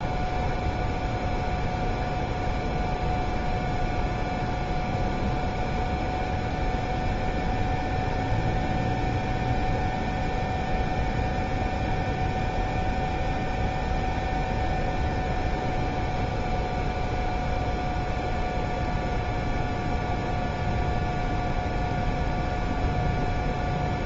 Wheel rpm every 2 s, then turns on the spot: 0, 0, 0, 0, 0, 0, 0, 0, 0, 0, 0, 0.
none